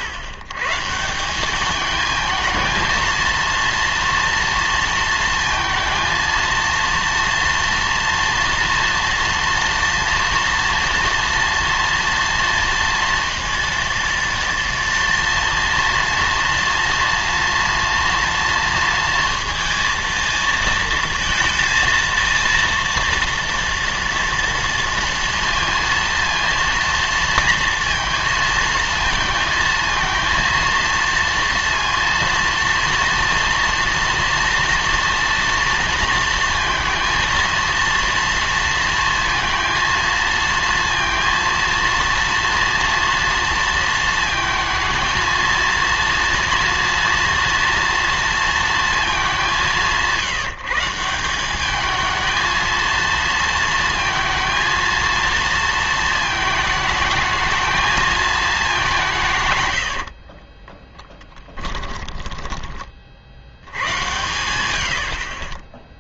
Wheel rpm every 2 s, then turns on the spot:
110, 220, 230, 230, 230, 240, 230, 230, 230, 230, 220, 230, 230, 230, 230, 230, 230, 230, 230, 230, 230, 230, 230, 230, 230, 160, 220, 230, 220, 200, 20, 20, 90.
60-62